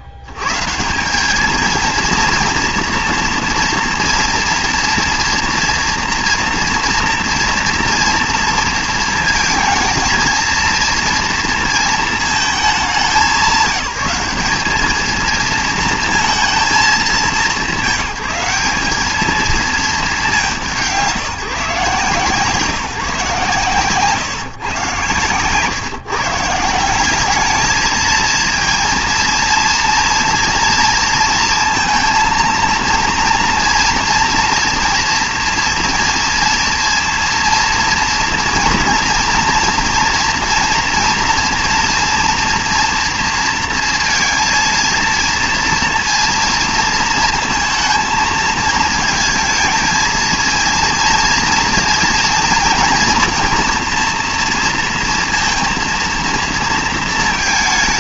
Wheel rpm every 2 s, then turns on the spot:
60, 230, 240, 230, 230, 230, 220, 200, 220, 200, 150, 160, 130, 160, 230, 230, 230, 230, 230, 230, 230, 230, 230, 230, 220, 230, 230, 230, 230.
none